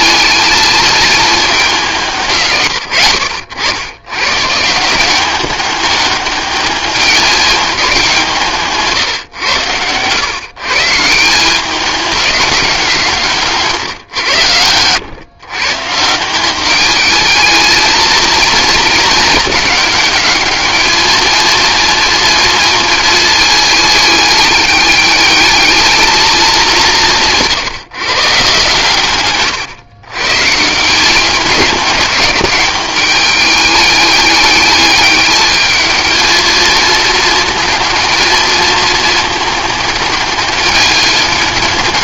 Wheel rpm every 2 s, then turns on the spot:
220, 90, 180, 210, 150, 150, 190, 110, 210, 220, 220, 220, 210, 190, 140, 170, 200, 210, 230, 220, 200.
none